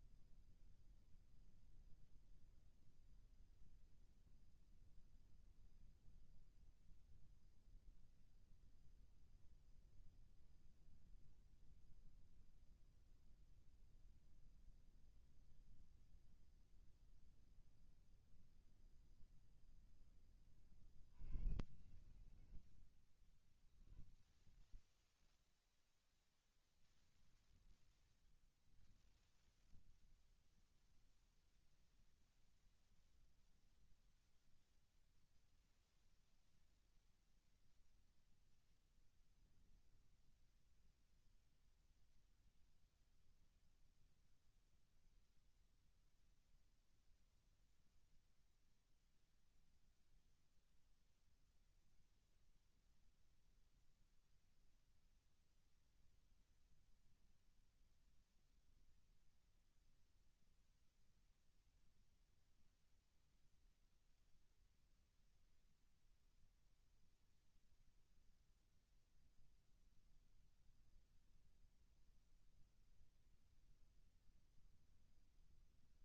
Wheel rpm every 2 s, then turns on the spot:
0, 0, 0, 0, 0, 0, 0, 0, 0, 0, 60, 40, 60, 90, 40, 0, 0, 0, 0, 0, 0, 0, 0, 0, 0, 0, 0, 0, 0, 0, 0, 0, 0, 0, 0, 0, 0, 0.
none